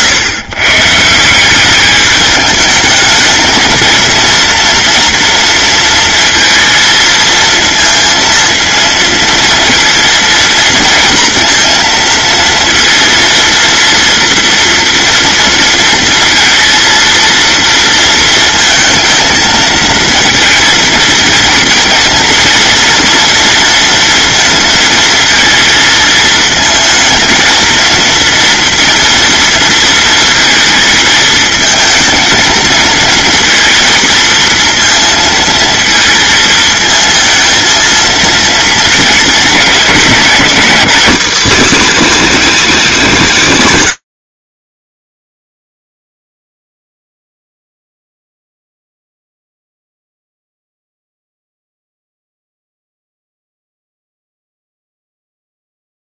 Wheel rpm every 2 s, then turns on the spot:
160, 210, 230, 230, 230, 230, 230, 230, 230, 220, 230, 230, 230, 230, 230, 220, 230, 230, 220, 220, 230, 210, 0, 0, 0, 0, 0, 0.
none